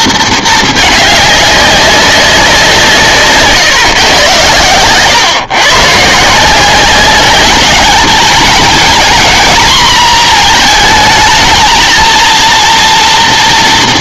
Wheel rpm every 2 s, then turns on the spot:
210, 180, 110, 190, 220, 220, 230.
none